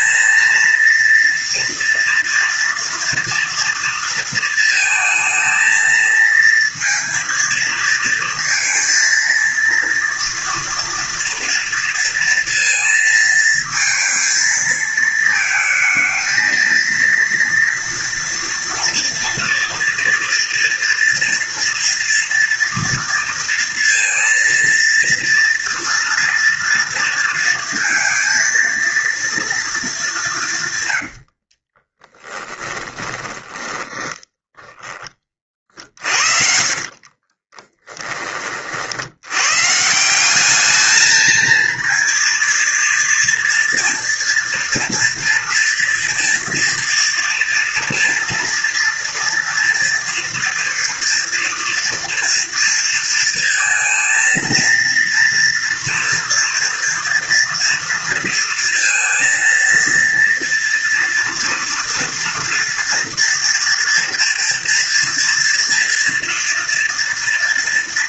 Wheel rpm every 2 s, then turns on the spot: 230, 230, 220, 230, 230, 230, 230, 220, 230, 230, 230, 230, 230, 230, 230, 110, 20, 30, 50, 70, 220, 230, 230, 230, 230, 230, 230, 230, 230, 230, 230, 230, 230, 230.
30-38